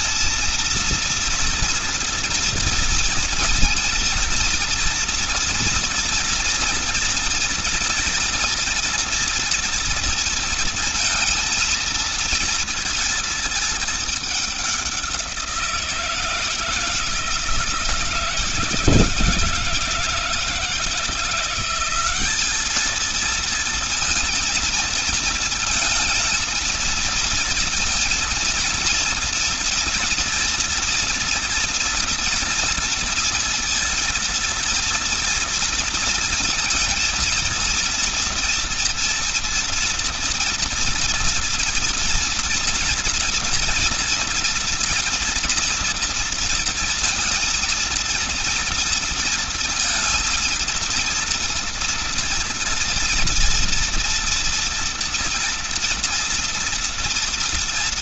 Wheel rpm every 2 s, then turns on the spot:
230, 230, 230, 230, 230, 230, 230, 190, 160, 160, 160, 220, 230, 230, 230, 230, 220, 230, 230, 230, 230, 230, 230, 230, 230, 230, 230, 230, 230.
none